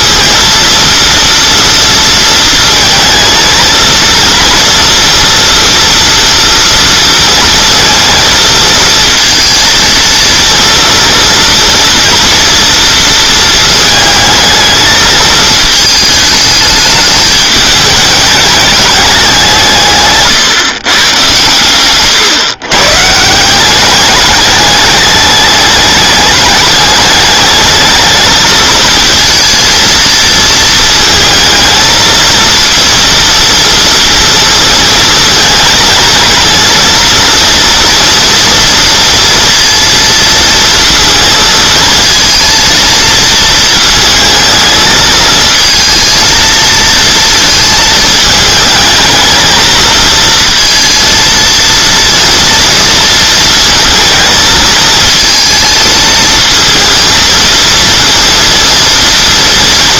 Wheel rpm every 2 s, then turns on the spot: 230, 230, 230, 230, 230, 230, 230, 220, 210, 210, 160, 130, 210, 210, 220, 220, 230, 230, 230, 230, 230, 230, 220, 230, 220, 230, 230, 220, 230, 230.
none